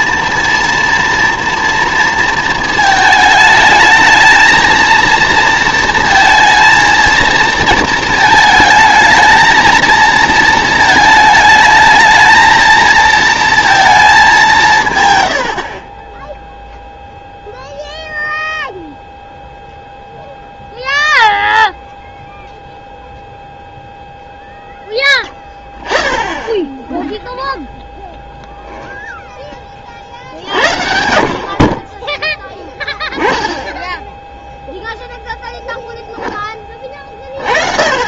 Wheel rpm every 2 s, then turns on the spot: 230, 220, 220, 230, 220, 230, 220, 170, 0, 0, 0, 0, 0, 0, 0, 60, 10, 0, 20.
none